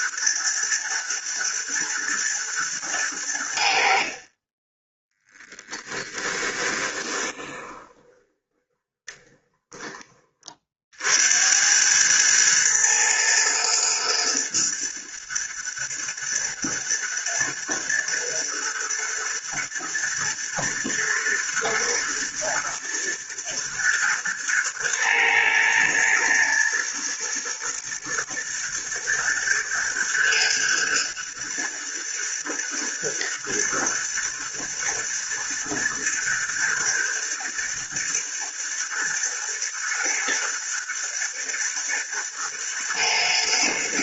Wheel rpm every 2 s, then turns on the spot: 120, 100, 10, 20, 20, 60, 110, 110, 120, 110, 120, 120, 110, 120, 120, 110, 110, 110, 110, 120, 110, 110.
6-10